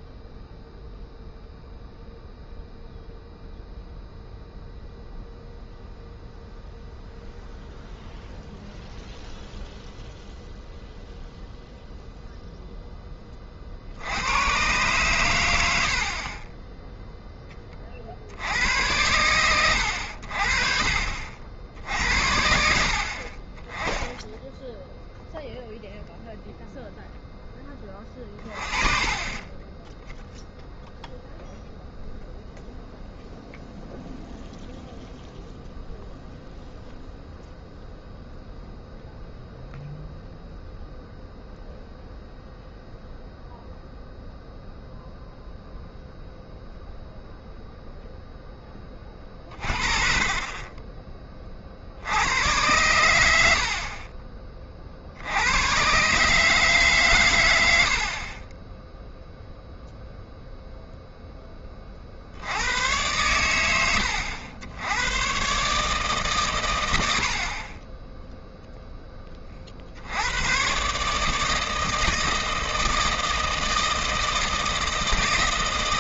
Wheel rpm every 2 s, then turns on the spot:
0, 0, 0, 0, 0, 0, 0, 110, 20, 80, 50, 60, 0, 0, 30, 0, 0, 0, 0, 0, 0, 0, 0, 0, 10, 20, 100, 30, 150, 20, 0, 90, 100, 120, 0, 120, 160, 160.
50-52